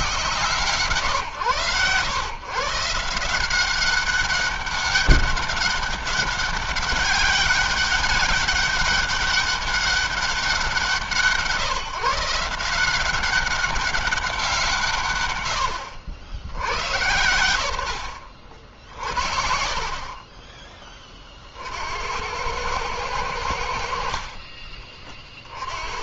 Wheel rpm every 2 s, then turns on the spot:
140, 150, 200, 200, 200, 170, 170, 160, 90, 60, 20, 100, 30.
16-18